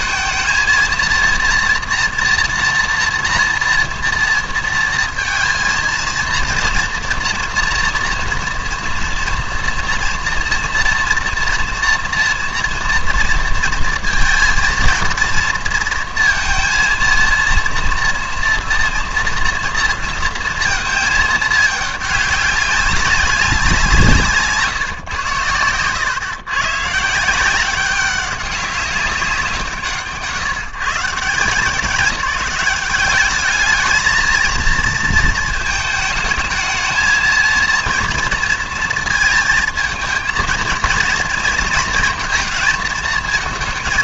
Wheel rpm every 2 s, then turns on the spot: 230, 240, 230, 230, 240, 230, 230, 230, 230, 230, 230, 200, 150, 130, 190, 150, 190, 230, 220, 230, 230, 230.
24-26